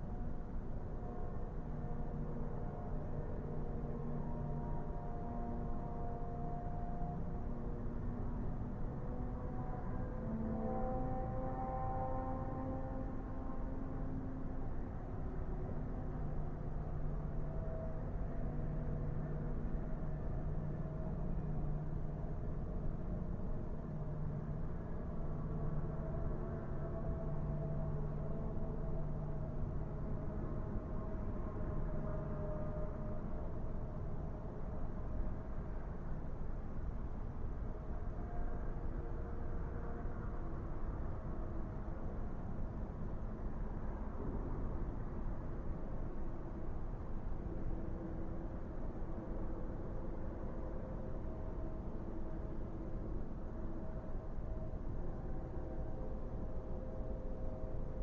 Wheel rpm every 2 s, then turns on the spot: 0, 0, 0, 0, 0, 0, 0, 0, 0, 0, 0, 0, 0, 0, 0, 0, 0, 0, 0, 0, 0, 0, 0, 0, 0, 0, 0, 0, 0.
none